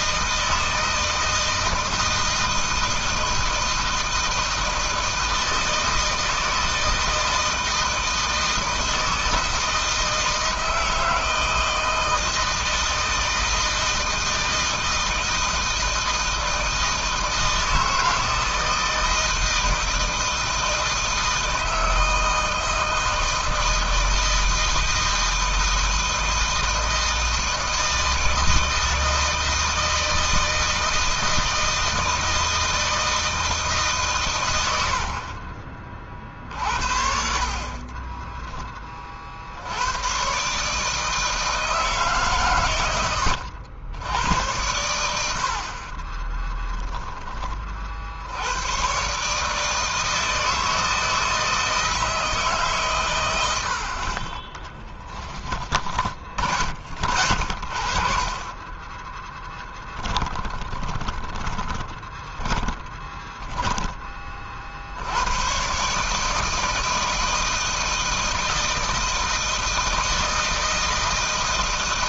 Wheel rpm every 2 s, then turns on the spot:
160, 160, 160, 160, 160, 160, 160, 160, 160, 160, 160, 160, 160, 160, 160, 160, 160, 100, 50, 10, 130, 130, 90, 30, 90, 160, 150, 30, 40, 30, 40, 10, 40, 160, 160, 160.
46-48 60-64